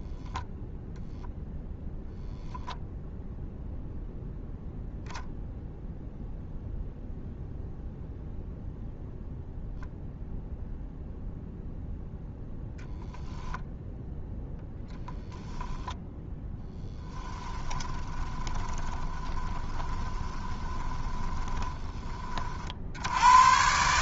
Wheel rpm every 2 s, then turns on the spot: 0, 20, 0, 0, 0, 0, 0, 0, 10, 10, 20, 60.
2-4 16-22